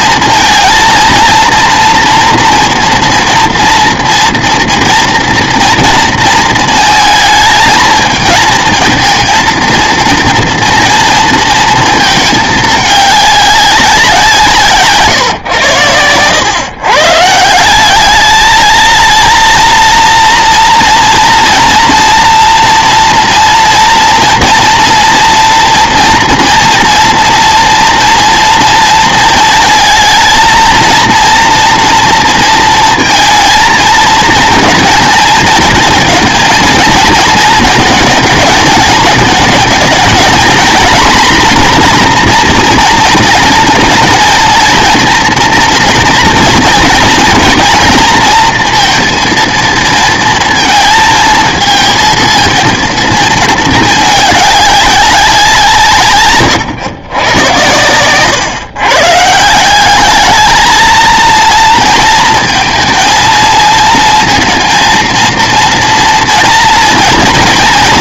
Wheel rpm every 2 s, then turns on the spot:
220, 230, 240, 230, 230, 230, 210, 150, 120, 220, 230, 230, 230, 230, 230, 230, 230, 230, 230, 210, 230, 240, 220, 230, 230, 230, 230, 200, 130, 130, 220, 230, 230, 230.
none